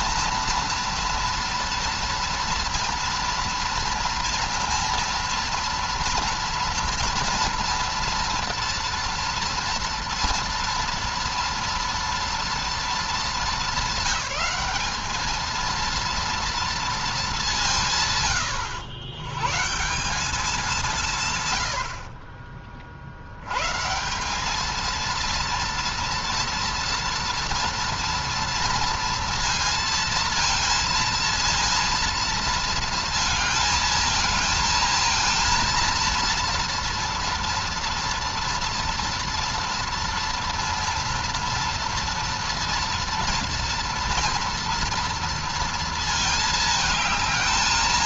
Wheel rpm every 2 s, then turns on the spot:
230, 230, 230, 230, 240, 240, 220, 200, 230, 100, 190, 50, 210, 230, 230, 230, 230, 220, 230, 230, 230, 230, 230, 220.
none